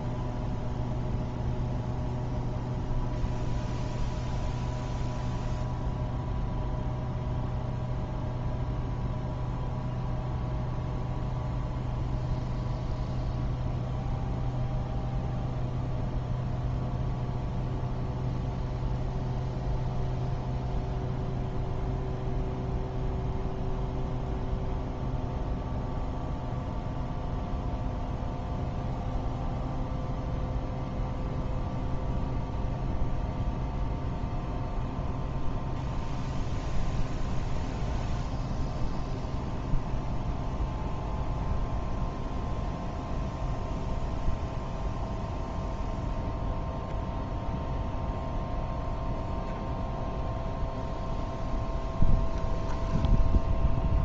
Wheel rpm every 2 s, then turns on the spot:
0, 0, 0, 0, 0, 0, 0, 0, 0, 0, 0, 0, 0, 0, 0, 0, 0, 0, 0, 0, 0, 0, 0, 0, 0, 0, 0.
none